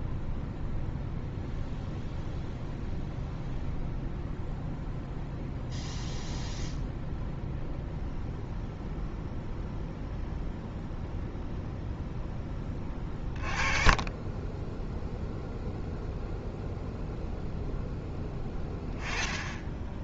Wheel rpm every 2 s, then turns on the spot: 0, 0, 0, 0, 0, 0, 20, 0, 0, 10.
none